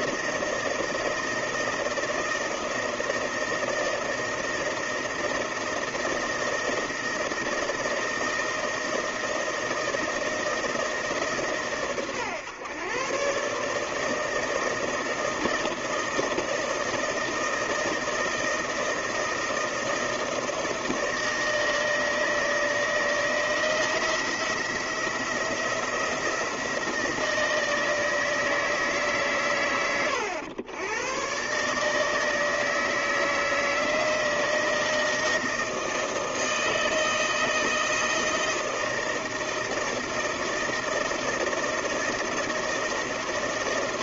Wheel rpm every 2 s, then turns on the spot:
160, 160, 160, 160, 160, 150, 130, 160, 160, 160, 160, 160, 170, 160, 120, 120, 160, 160, 160, 160, 160, 160.
none